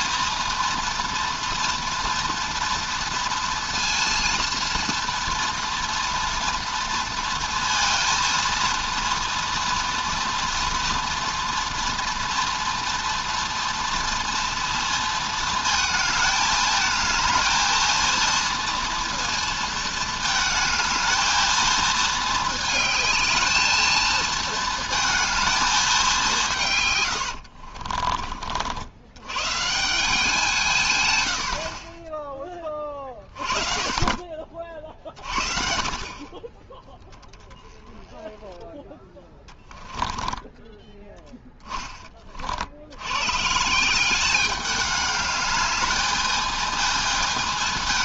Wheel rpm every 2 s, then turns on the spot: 230, 230, 230, 230, 230, 230, 230, 230, 220, 230, 220, 220, 220, 150, 80, 170, 20, 40, 30, 10, 10, 60, 200, 220.
40-42